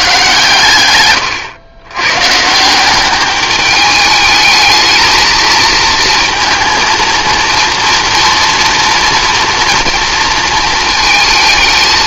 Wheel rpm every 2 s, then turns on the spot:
120, 180, 220, 230, 240, 220.
none